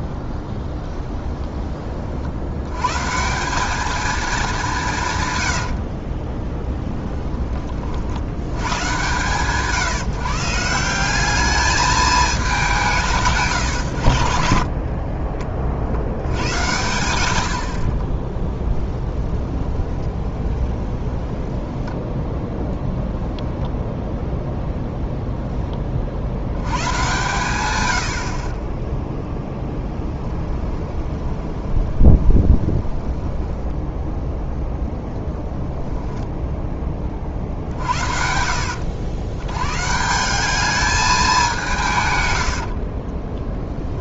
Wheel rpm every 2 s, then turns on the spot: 20, 90, 200, 20, 100, 160, 190, 50, 100, 10, 20, 0, 0, 100, 30, 20, 20, 0, 10, 80, 200, 70.
0-2 6-8 14-16 18-22 30-34 42-44